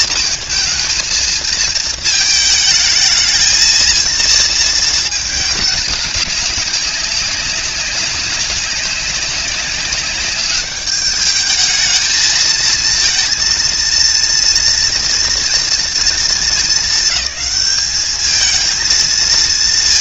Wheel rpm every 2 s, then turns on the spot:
220, 220, 230, 200, 190, 200, 220, 230, 210, 220.
none